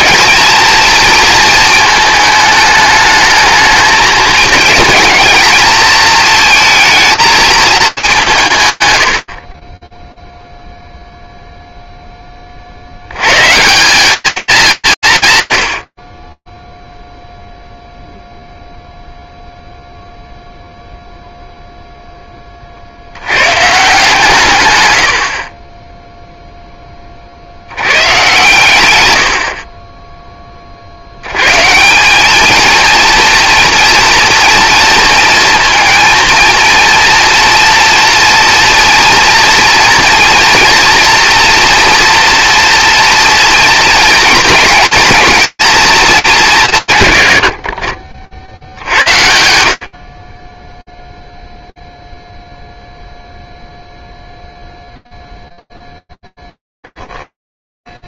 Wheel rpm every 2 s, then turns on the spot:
240, 220, 220, 230, 200, 0, 30, 210, 10, 0, 0, 80, 90, 30, 100, 90, 230, 230, 230, 230, 230, 230, 230, 130, 80, 0, 0, 0, 0.
none